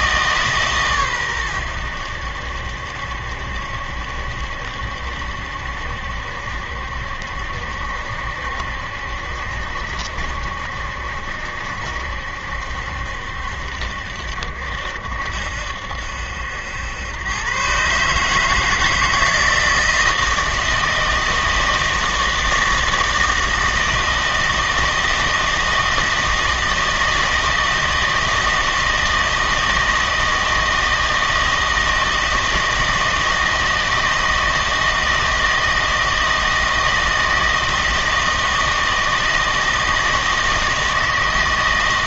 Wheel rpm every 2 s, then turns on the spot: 140, 70, 70, 70, 70, 70, 70, 70, 90, 160, 160, 160, 160, 160, 160, 160, 160, 160, 160, 160, 160.
none